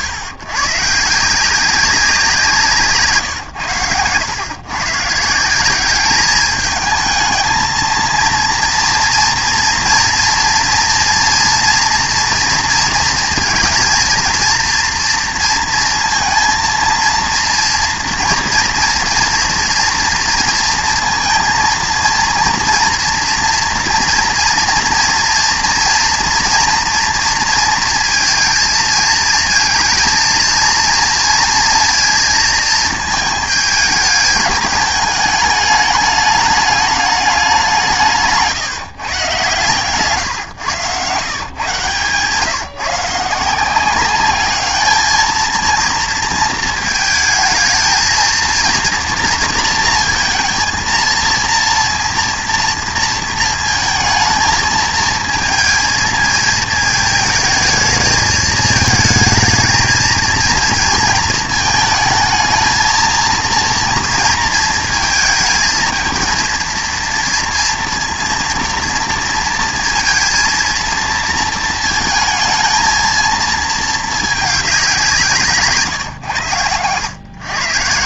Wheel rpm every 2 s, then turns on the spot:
140, 170, 120, 210, 230, 240, 240, 230, 230, 230, 230, 230, 240, 230, 230, 230, 230, 210, 220, 170, 120, 150, 210, 230, 230, 230, 230, 220, 220, 220, 230, 220, 230, 230, 230, 230, 230, 200, 110.
2-4